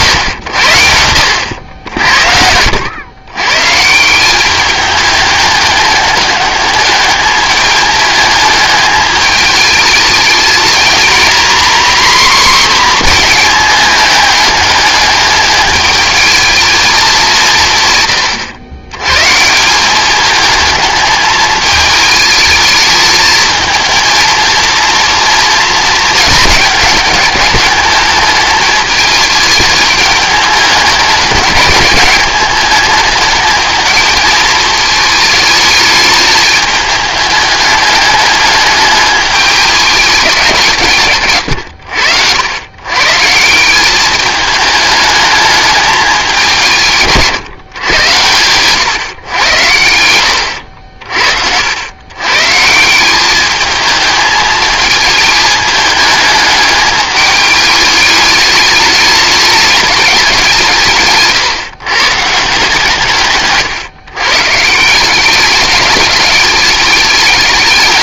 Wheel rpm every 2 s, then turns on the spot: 90, 90, 200, 210, 210, 230, 240, 210, 220, 110, 210, 220, 230, 210, 210, 210, 210, 220, 210, 210, 160, 110, 210, 150, 120, 80, 160, 220, 210, 210, 170, 150, 160, 200.
50-52